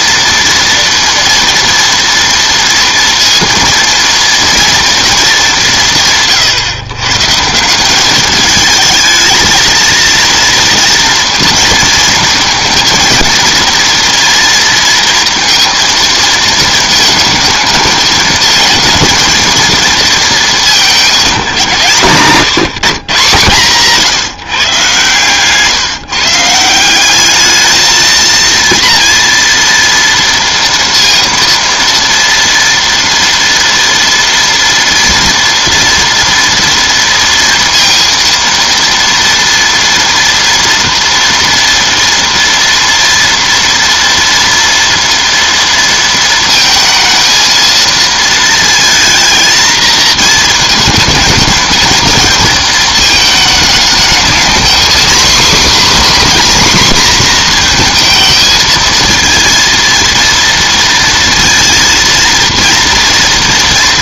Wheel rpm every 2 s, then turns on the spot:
230, 230, 230, 130, 220, 230, 230, 230, 220, 220, 210, 140, 130, 170, 230, 230, 230, 230, 230, 230, 230, 230, 230, 230, 230, 220, 220, 240, 260, 220, 230, 230.
none